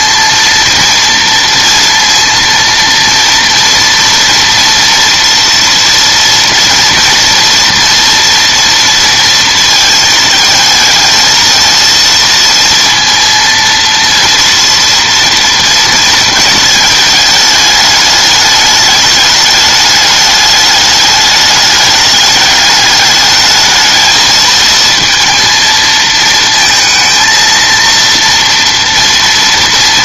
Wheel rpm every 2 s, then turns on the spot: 230, 230, 230, 230, 230, 220, 230, 230, 220, 210, 210, 210, 220, 230, 230.
none